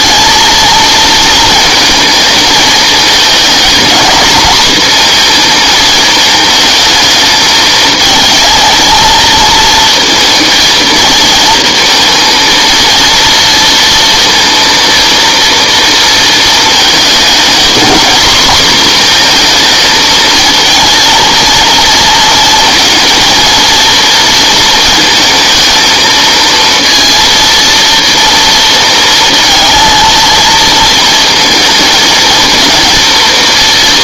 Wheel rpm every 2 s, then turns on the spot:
220, 220, 230, 220, 220, 230, 230, 230, 220, 250, 230, 230, 230, 230, 230, 230, 230.
none